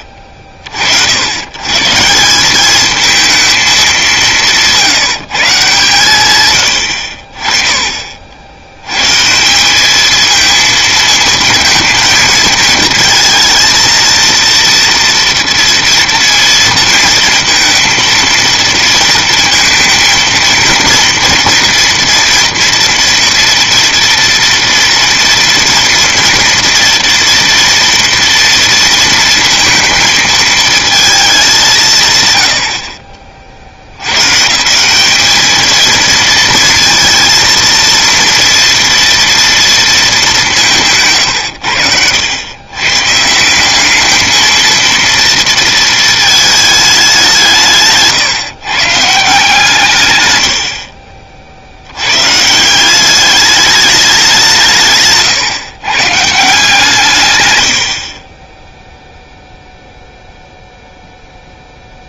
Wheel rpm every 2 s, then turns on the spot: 50, 200, 180, 110, 80, 220, 220, 230, 230, 230, 230, 230, 230, 240, 230, 220, 110, 160, 230, 230, 180, 100, 220, 220, 140, 90, 160, 170, 150, 10, 0.
58-60